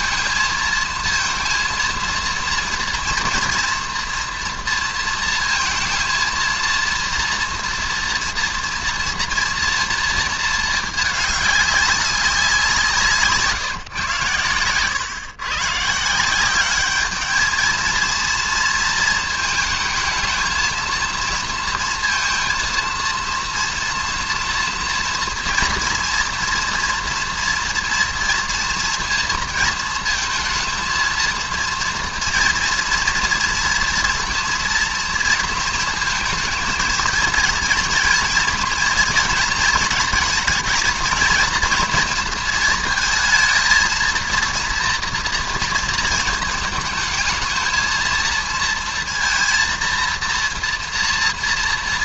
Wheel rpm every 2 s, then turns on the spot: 220, 230, 230, 230, 230, 220, 180, 120, 200, 230, 230, 230, 240, 230, 230, 230, 240, 230, 230, 240, 230, 230, 230, 220, 230, 230.
none